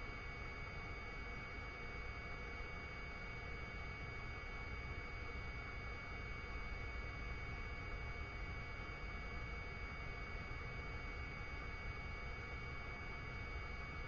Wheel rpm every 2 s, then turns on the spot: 0, 0, 0, 0, 0, 0, 0.
none